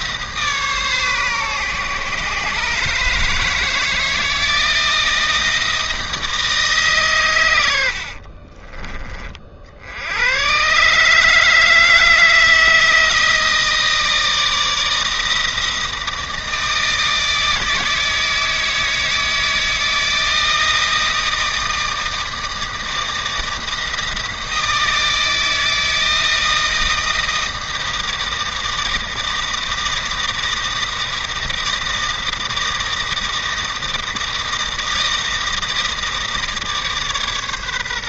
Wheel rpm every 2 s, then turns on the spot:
150, 150, 160, 150, 30, 130, 160, 160, 160, 160, 160, 160, 160, 160, 160, 160, 160, 160, 150.
8-10